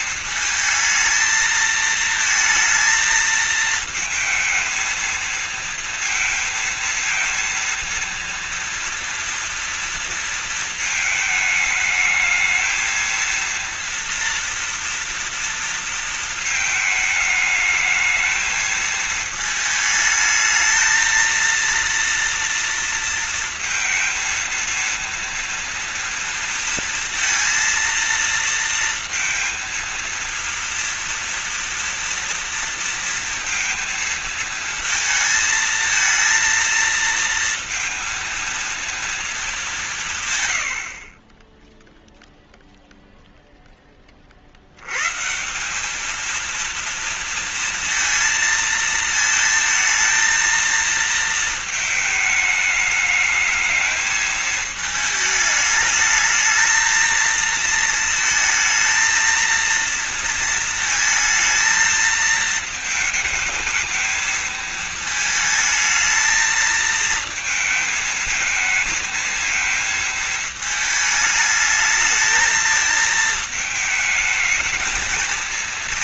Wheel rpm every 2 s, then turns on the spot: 220, 230, 220, 230, 230, 230, 220, 230, 230, 220, 220, 230, 230, 230, 230, 230, 230, 230, 230, 230, 130, 0, 40, 220, 230, 230, 220, 220, 220, 220, 230, 220, 220, 230, 220, 220, 220, 220.
none